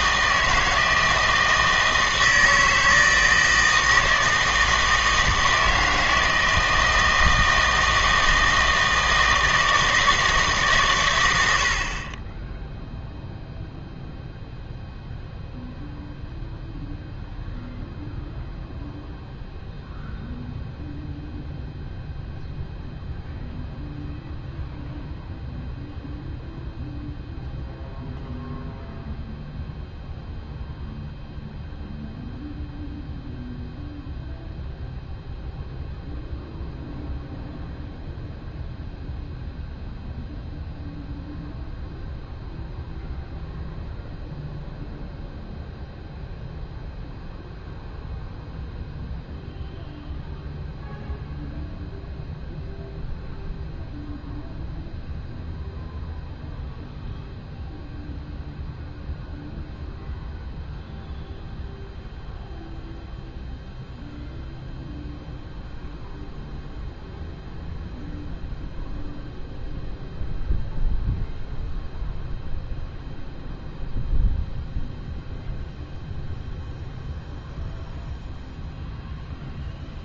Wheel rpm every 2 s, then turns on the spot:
160, 160, 160, 160, 160, 140, 0, 0, 0, 0, 0, 0, 0, 0, 0, 0, 0, 0, 0, 0, 0, 0, 0, 0, 0, 0, 0, 0, 0, 0, 0, 0, 0, 0, 0, 0, 0, 0, 0, 0.
none